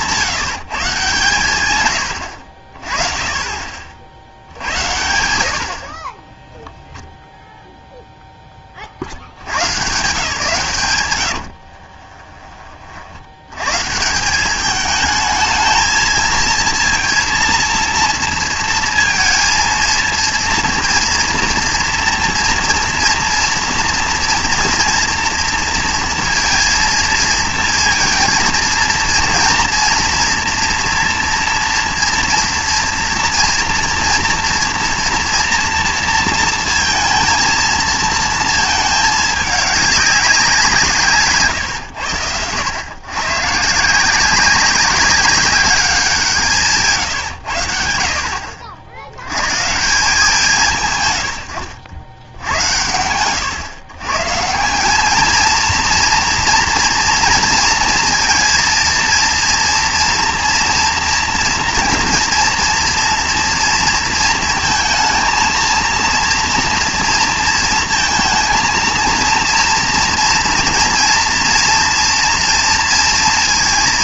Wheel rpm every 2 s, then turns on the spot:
140, 40, 80, 0, 10, 140, 40, 210, 230, 230, 230, 230, 230, 230, 230, 230, 230, 230, 230, 220, 190, 110, 190, 150, 70, 150, 110, 180, 240, 230, 230, 230, 220, 230, 230, 230, 230.
none